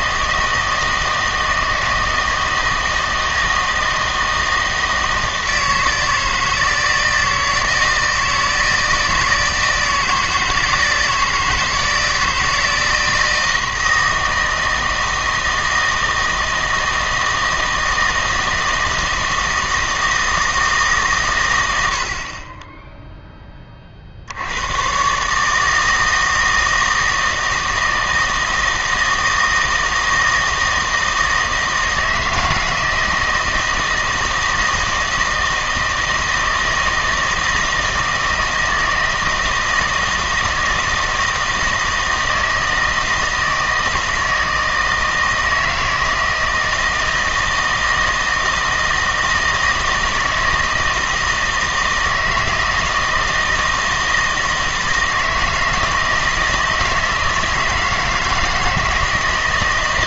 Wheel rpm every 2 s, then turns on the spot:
160, 160, 160, 160, 160, 160, 160, 160, 160, 160, 160, 20, 100, 160, 160, 160, 160, 160, 160, 160, 160, 160, 160, 160, 160, 160, 160, 160, 160, 160.
none